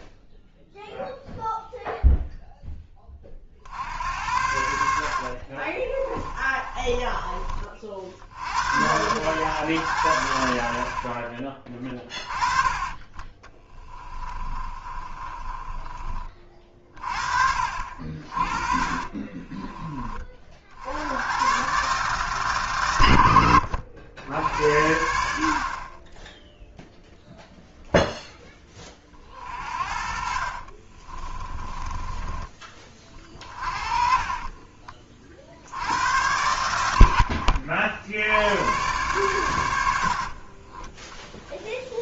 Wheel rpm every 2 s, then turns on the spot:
0, 10, 80, 30, 90, 80, 30, 30, 30, 40, 60, 140, 80, 0, 20, 40, 30, 30, 100, 100, 30.
4-8 14-20 30-32 34-36 40-42